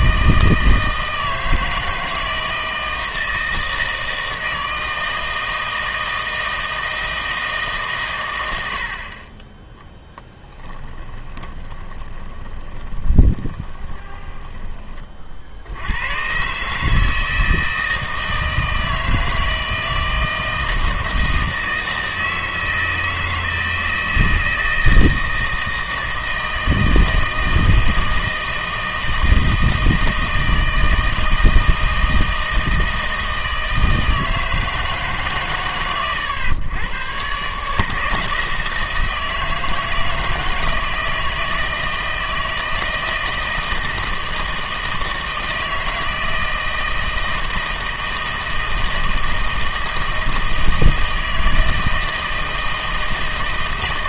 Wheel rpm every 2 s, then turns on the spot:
160, 160, 160, 160, 80, 10, 20, 20, 140, 160, 160, 160, 160, 160, 160, 160, 160, 160, 100, 160, 160, 160, 160, 160, 160, 160, 160.
10-14